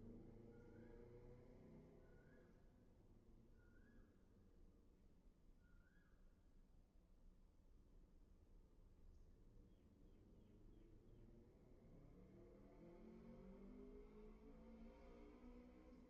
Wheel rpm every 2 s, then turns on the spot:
0, 0, 0, 0, 0, 0, 0, 0.
none